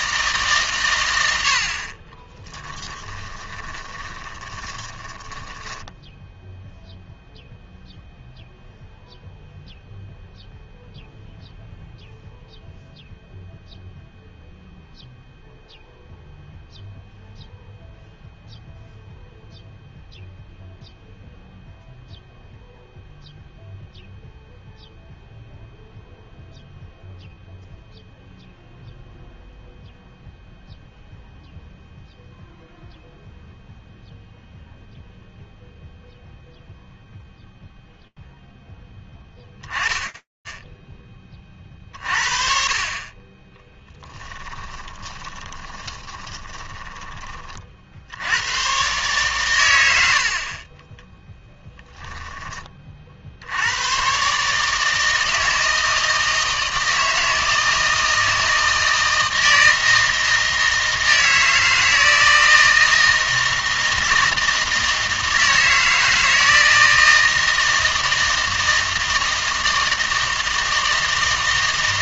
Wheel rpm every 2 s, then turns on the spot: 140, 10, 20, 0, 0, 0, 0, 0, 0, 0, 0, 0, 0, 0, 0, 0, 0, 0, 0, 10, 30, 20, 20, 20, 140, 10, 40, 160, 160, 160, 160, 160, 160, 160, 160, 160.
2-6 44-46 50-52